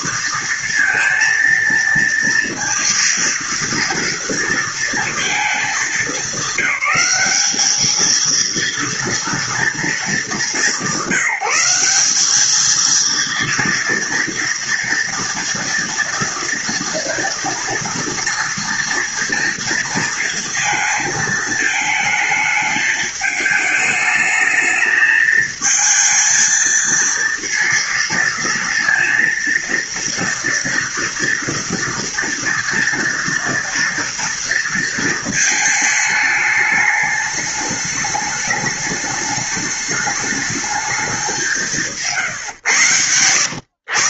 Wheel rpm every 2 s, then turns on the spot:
230, 230, 230, 210, 230, 190, 220, 230, 230, 230, 220, 220, 220, 230, 230, 240, 230, 230, 210, 210, 210, 120.
none